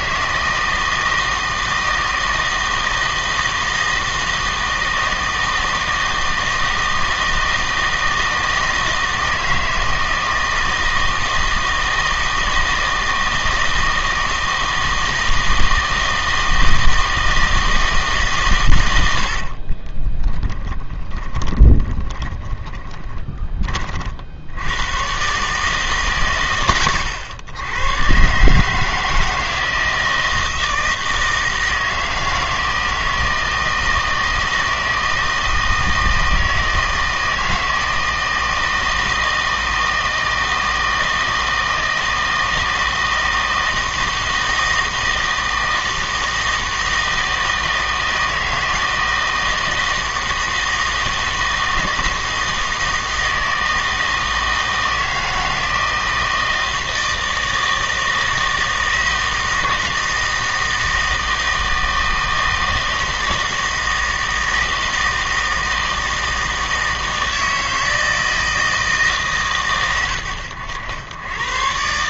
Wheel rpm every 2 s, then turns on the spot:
160, 160, 160, 160, 160, 160, 160, 160, 160, 120, 20, 20, 100, 100, 150, 160, 160, 160, 160, 160, 160, 160, 160, 160, 160, 160, 160, 160, 160, 160, 160, 160, 160, 160, 160, 100.
20-24